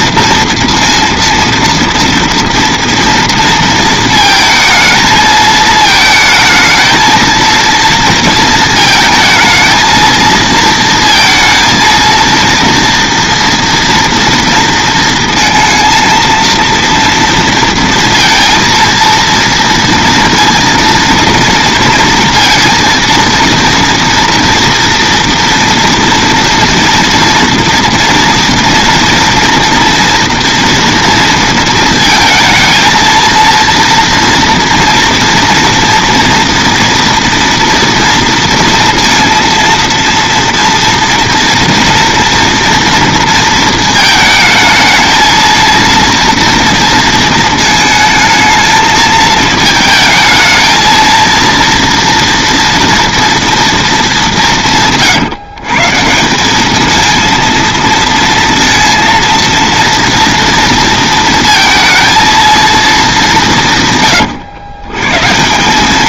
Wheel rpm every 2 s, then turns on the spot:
230, 230, 220, 220, 220, 230, 230, 230, 230, 230, 230, 230, 230, 230, 230, 230, 220, 240, 230, 230, 230, 240, 220, 230, 220, 220, 230, 150, 200, 230, 230, 230, 100.
none